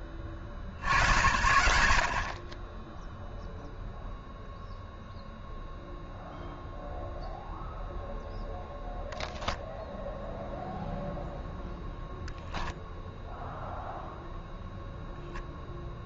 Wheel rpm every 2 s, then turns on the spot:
60, 0, 0, 0, 0, 0, 0, 0.
none